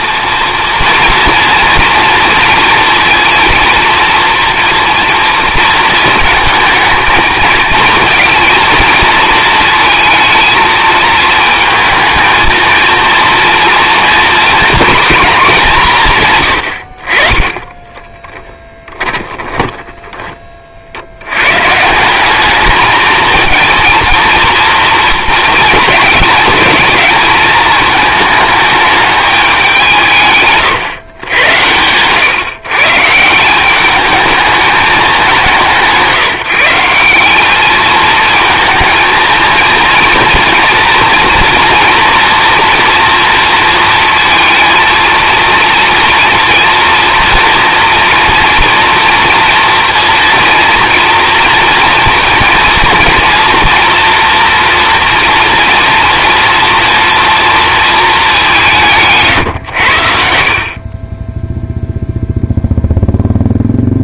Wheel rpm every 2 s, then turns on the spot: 230, 230, 230, 220, 220, 220, 230, 240, 80, 10, 50, 210, 230, 210, 220, 140, 140, 210, 170, 220, 230, 230, 230, 230, 230, 230, 230, 240, 230, 180, 50, 0.
18-20